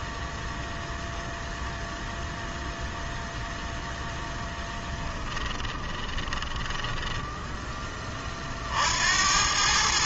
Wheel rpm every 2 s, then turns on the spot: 0, 0, 10, 10, 70.
4-8